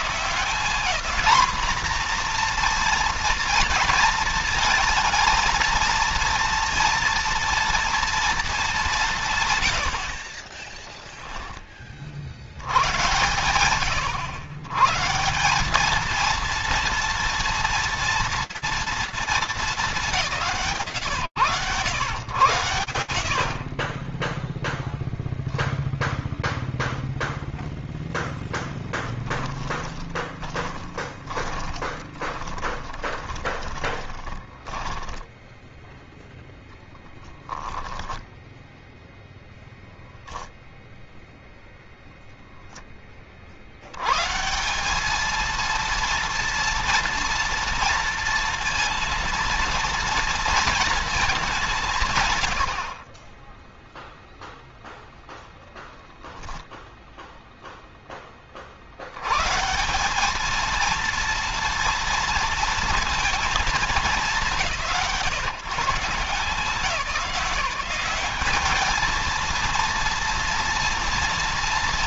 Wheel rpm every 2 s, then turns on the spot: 210, 230, 220, 230, 200, 20, 90, 110, 230, 230, 120, 50, 0, 0, 20, 20, 20, 10, 10, 0, 0, 20, 180, 230, 230, 230, 80, 0, 0, 60, 230, 230, 150, 160, 220, 230.
10-12 28-36